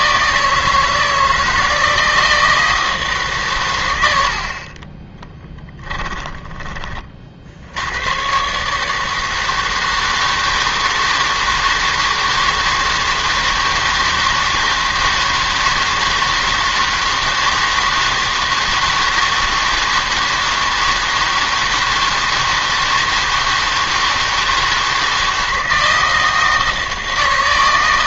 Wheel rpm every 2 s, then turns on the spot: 160, 160, 50, 10, 140, 160, 160, 160, 160, 160, 160, 160, 160, 160.
none